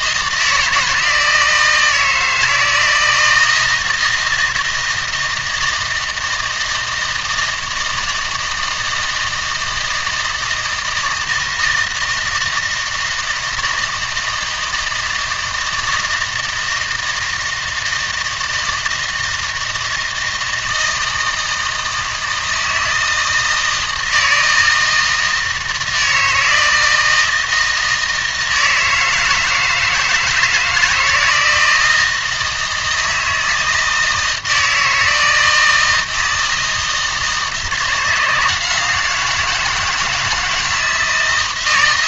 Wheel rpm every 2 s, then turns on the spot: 160, 160, 160, 160, 160, 160, 160, 160, 160, 160, 160, 160, 160, 160, 160, 170, 160, 160, 160, 170, 160.
none